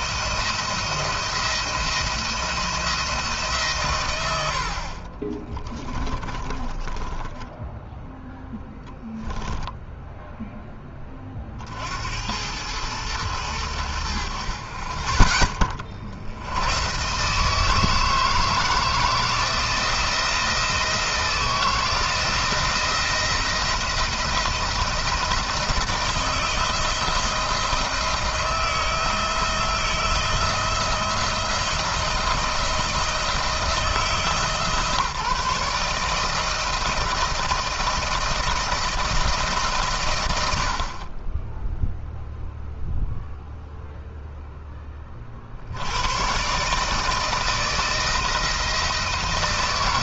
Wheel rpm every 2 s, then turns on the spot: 170, 170, 70, 20, 0, 0, 80, 40, 110, 160, 170, 170, 170, 170, 160, 160, 170, 160, 160, 170, 70, 0, 10, 140, 160.
4-8